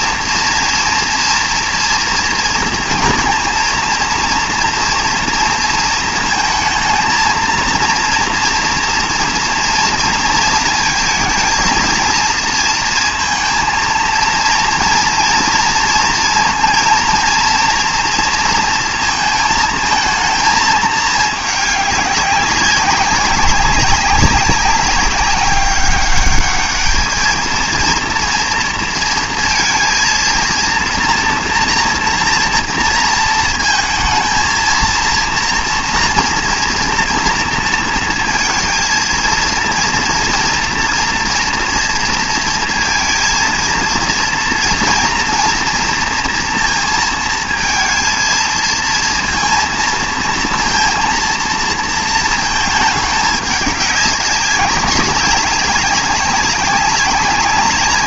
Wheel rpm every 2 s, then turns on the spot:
230, 230, 230, 220, 230, 230, 230, 230, 230, 230, 220, 190, 200, 210, 230, 230, 230, 230, 230, 230, 230, 230, 230, 230, 230, 230, 210, 200, 190.
none